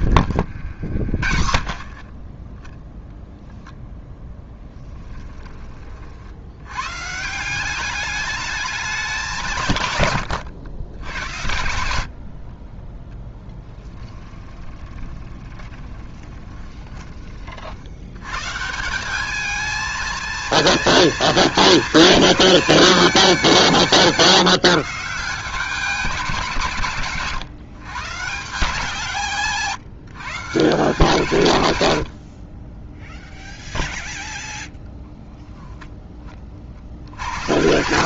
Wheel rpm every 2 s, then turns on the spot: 70, 10, 10, 110, 210, 110, 30, 20, 20, 170, 220, 210, 160, 150, 170, 160, 20, 0, 50.
4-6 12-18